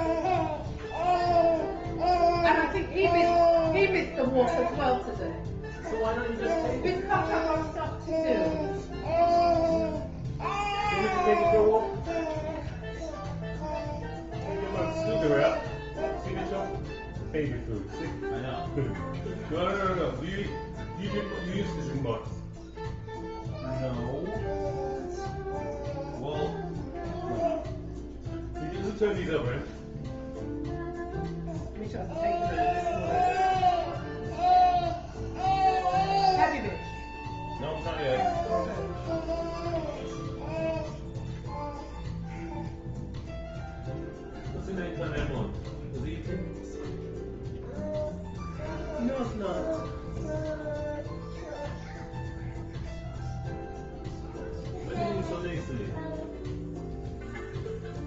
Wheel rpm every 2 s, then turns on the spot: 0, 0, 0, 0, 0, 0, 0, 0, 0, 0, 0, 0, 0, 0, 0, 0, 0, 0, 0, 0, 0, 0, 0, 0, 0, 0, 0, 0, 0.
none